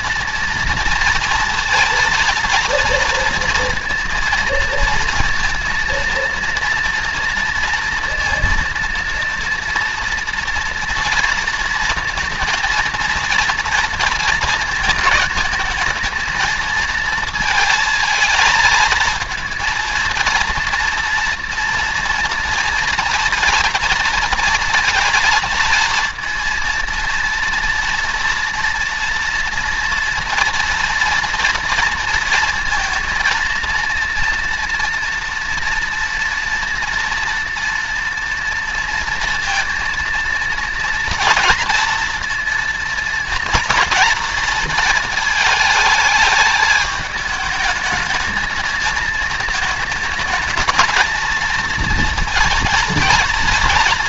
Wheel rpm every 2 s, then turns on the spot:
230, 230, 230, 230, 230, 230, 230, 220, 230, 230, 230, 230, 230, 230, 230, 230, 230, 240, 230, 230, 230, 230, 230, 220, 220, 220, 230.
none